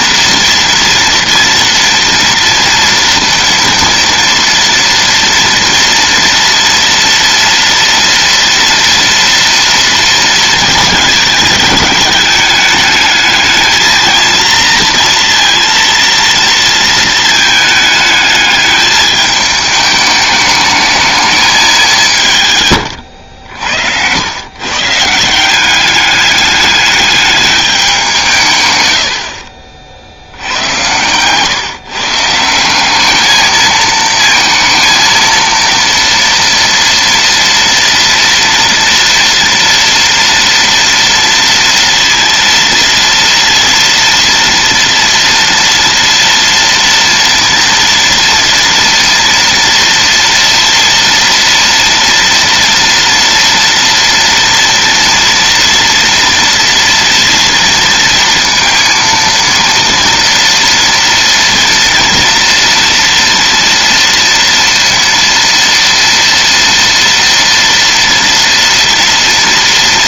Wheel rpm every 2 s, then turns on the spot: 230, 230, 230, 230, 230, 220, 210, 230, 230, 210, 210, 130, 130, 210, 130, 90, 180, 230, 230, 240, 230, 230, 230, 230, 240, 230, 230, 230, 230, 230, 230, 230, 230, 230, 230.
none